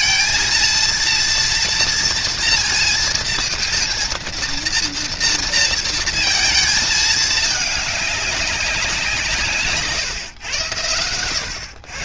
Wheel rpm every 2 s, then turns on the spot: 230, 230, 230, 220, 190, 100.
none